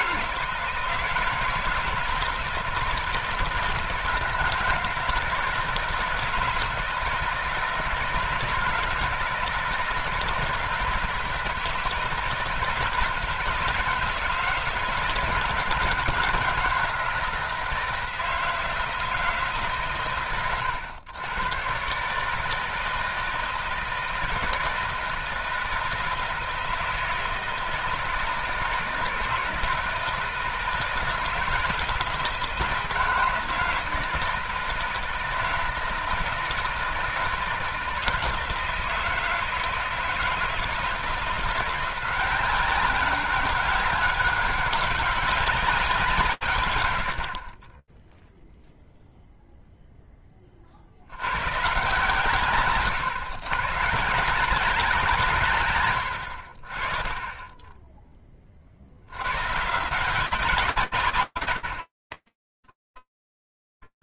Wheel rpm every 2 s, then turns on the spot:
160, 160, 160, 160, 160, 160, 160, 160, 160, 160, 100, 160, 160, 160, 160, 160, 160, 160, 160, 160, 160, 190, 190, 110, 0, 50, 130, 180, 40, 80, 150, 20.
none